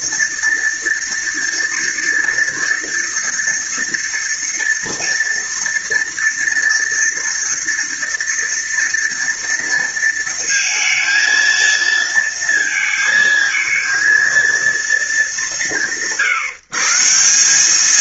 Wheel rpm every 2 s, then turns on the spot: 230, 230, 230, 230, 230, 230, 230, 230, 160.
none